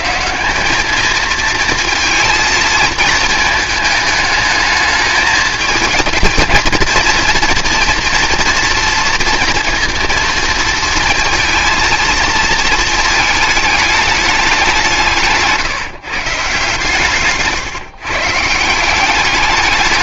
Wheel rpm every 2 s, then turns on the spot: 200, 220, 210, 230, 230, 230, 230, 190, 150, 170.
none